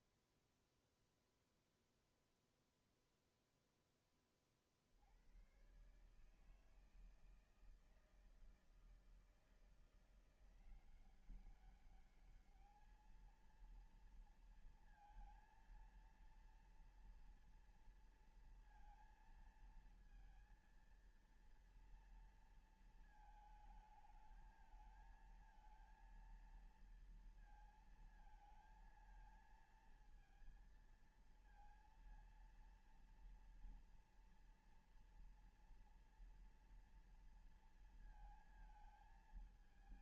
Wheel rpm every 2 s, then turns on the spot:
0, 10, 130, 160, 170, 200, 230, 230, 230, 230, 230, 220, 220, 230, 230, 230, 230, 240, 230, 220.
none